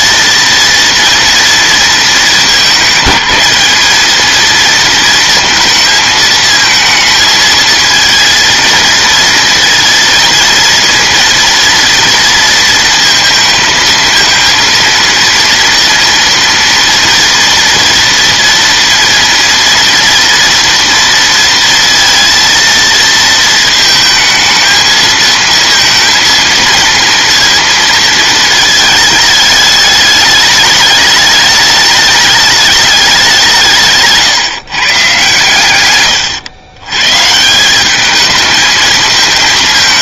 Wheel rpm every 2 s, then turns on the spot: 230, 210, 230, 220, 230, 230, 230, 230, 230, 230, 230, 230, 220, 230, 220, 210, 210, 140, 120, 220.
none